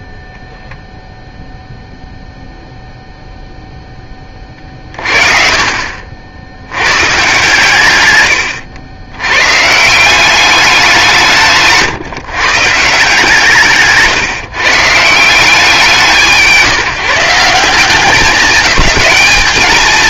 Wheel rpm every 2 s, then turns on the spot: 0, 0, 40, 110, 100, 180, 140, 130, 140, 210.
4-6